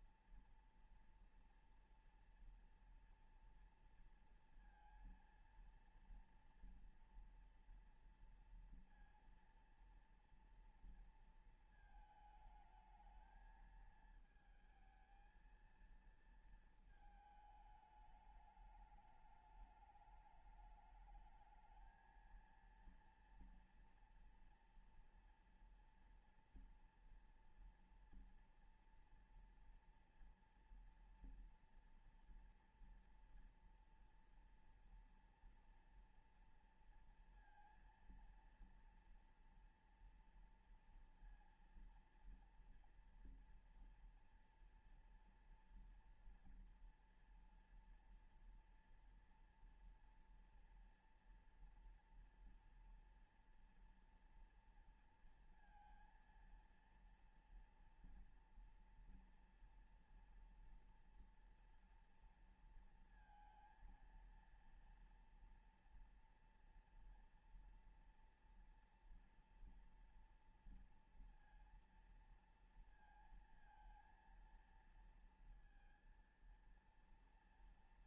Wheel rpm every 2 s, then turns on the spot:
230, 230, 230, 230, 230, 230, 220, 220, 230, 210, 210, 230, 230, 230, 230, 230, 230, 240, 240, 230, 230, 230, 230, 230, 240, 230, 230, 230, 230, 230, 230, 230, 230, 230, 240, 230, 230, 230, 230.
none